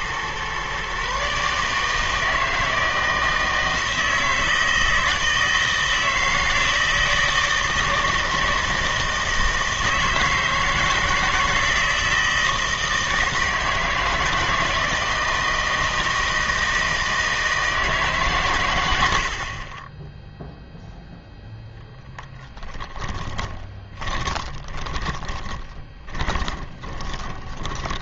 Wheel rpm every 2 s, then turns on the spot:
130, 160, 160, 160, 160, 160, 160, 160, 160, 100, 0, 20, 20, 20.
22-28